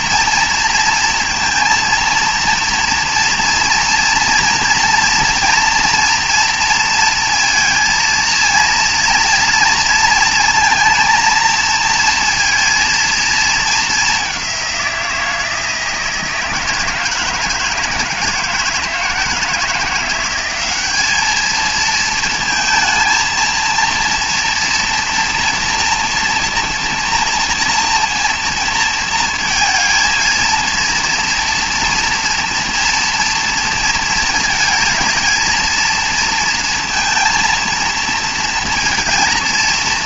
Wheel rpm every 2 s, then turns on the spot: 230, 230, 230, 230, 230, 230, 230, 180, 160, 160, 200, 230, 240, 230, 230, 230, 230, 220, 220, 230.
none